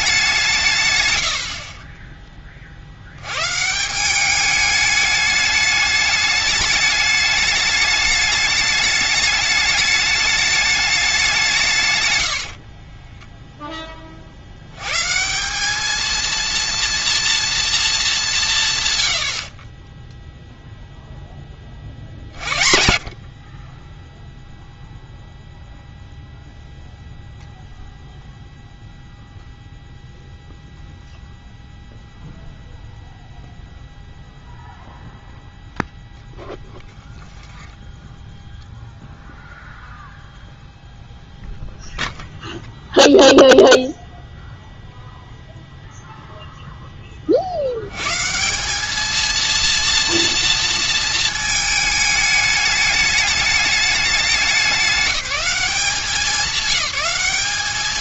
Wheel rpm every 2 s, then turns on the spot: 150, 40, 210, 210, 210, 210, 50, 90, 230, 150, 0, 50, 0, 0, 0, 0, 0, 0, 0, 0, 0, 0, 0, 0, 180, 230, 210, 190, 190.
12-14